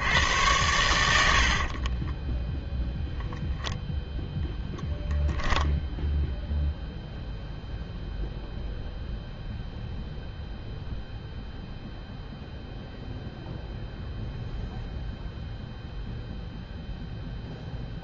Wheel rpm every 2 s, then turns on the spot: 90, 10, 10, 0, 0, 0, 0, 0, 0.
4-6